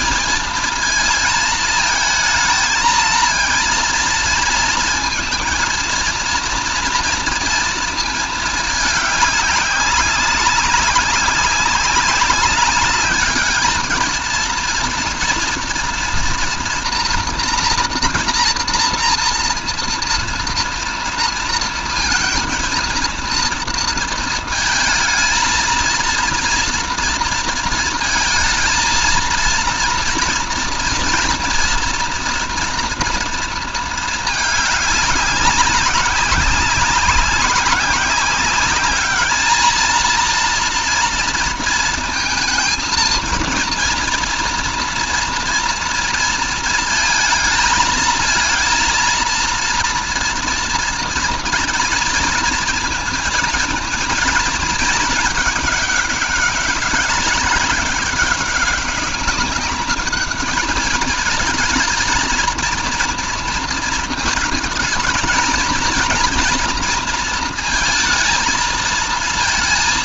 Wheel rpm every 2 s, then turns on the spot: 220, 230, 230, 230, 210, 190, 200, 230, 230, 240, 230, 230, 230, 230, 220, 230, 240, 210, 200, 210, 230, 230, 230, 220, 230, 230, 230, 220, 200, 200, 210, 230, 220, 230, 230.
none